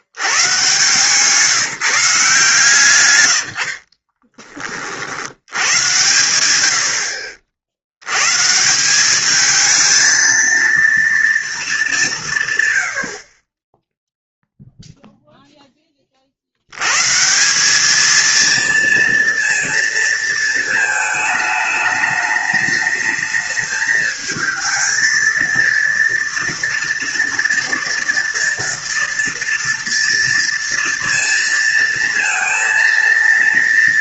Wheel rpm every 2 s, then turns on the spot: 120, 140, 30, 80, 160, 230, 120, 0, 80, 230, 220, 220, 220, 230, 230, 230, 230.
none